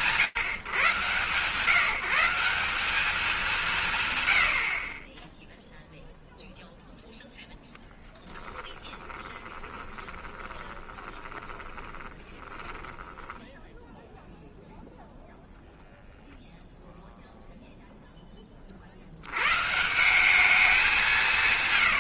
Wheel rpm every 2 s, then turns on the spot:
130, 200, 60, 0, 10, 20, 20, 0, 0, 30, 180.
8-14